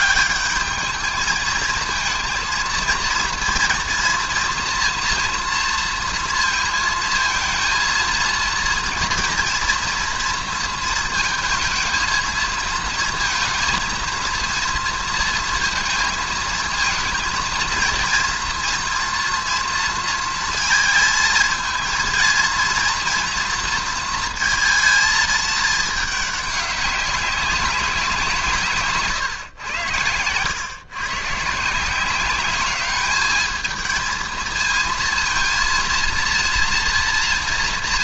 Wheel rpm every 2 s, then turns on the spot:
210, 230, 230, 230, 230, 230, 230, 230, 220, 230, 220, 230, 230, 200, 150, 110, 200, 220, 230.
none